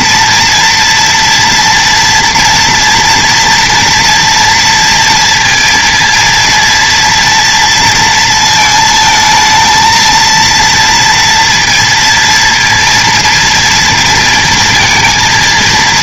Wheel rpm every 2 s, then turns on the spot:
230, 230, 230, 230, 220, 230, 230, 230.
none